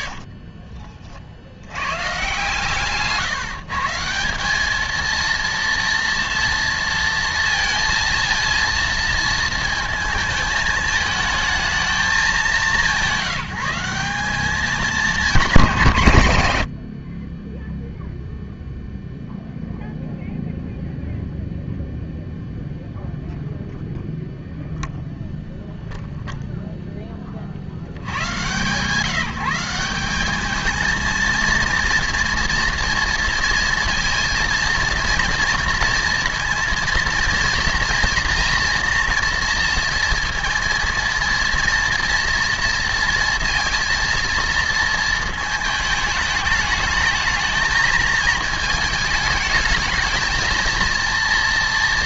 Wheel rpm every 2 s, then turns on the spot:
30, 150, 220, 230, 230, 220, 170, 200, 80, 0, 0, 0, 0, 0, 140, 210, 240, 230, 230, 230, 230, 230, 230, 210, 220, 230.
0-2